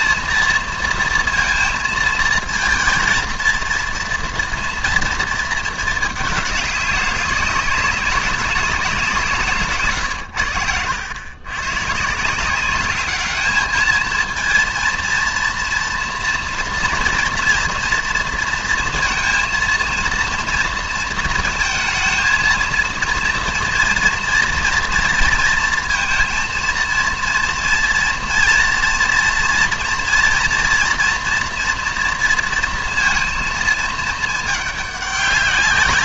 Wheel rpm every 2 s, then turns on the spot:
230, 230, 230, 200, 190, 90, 190, 230, 230, 230, 230, 230, 230, 230, 230, 240, 230, 210.
none